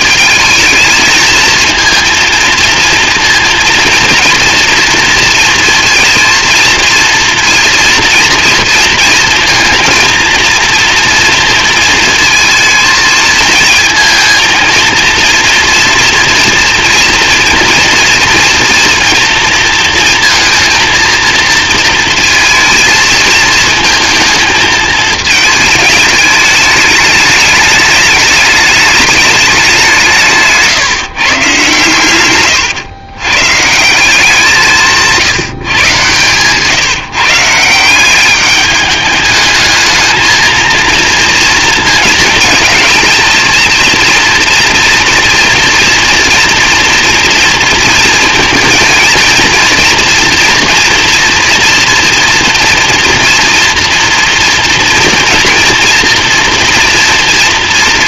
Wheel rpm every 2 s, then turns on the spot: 220, 230, 230, 230, 230, 230, 220, 230, 230, 230, 230, 220, 220, 210, 210, 150, 110, 170, 150, 210, 230, 230, 230, 230, 230, 230, 230, 230, 230.
none